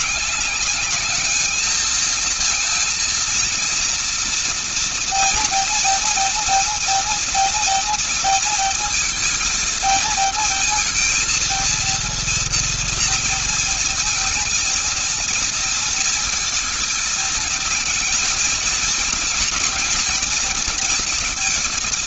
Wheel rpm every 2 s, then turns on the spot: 200, 230, 230, 240, 230, 230, 230, 230, 230, 230, 230.
none